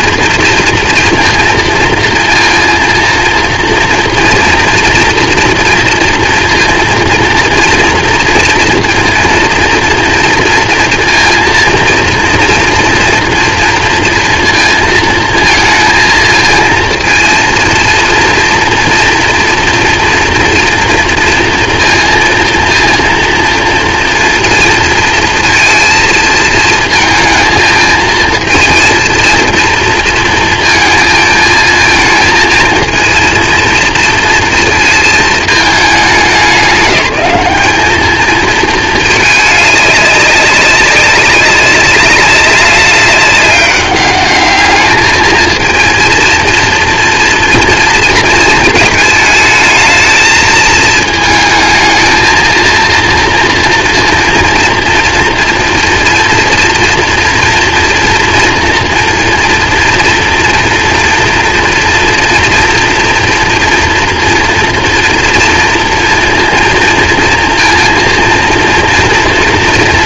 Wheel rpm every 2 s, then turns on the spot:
230, 230, 230, 230, 230, 230, 230, 230, 230, 230, 230, 230, 230, 230, 220, 230, 220, 230, 200, 200, 200, 200, 200, 230, 230, 220, 220, 230, 230, 240, 230, 240, 230, 230, 230.
none